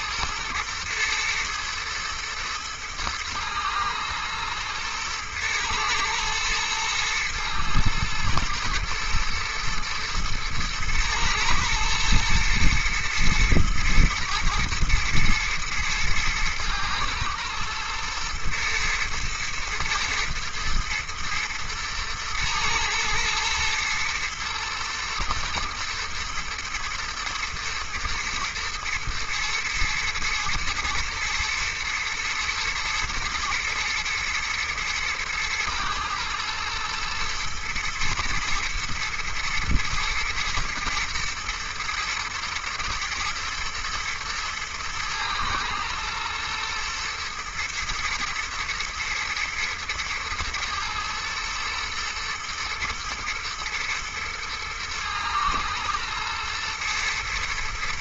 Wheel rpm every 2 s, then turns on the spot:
120, 110, 110, 120, 120, 110, 120, 110, 120, 110, 120, 120, 120, 110, 110, 110, 120, 110, 110, 120, 110, 110, 110, 110, 110, 110, 110, 110, 120.
none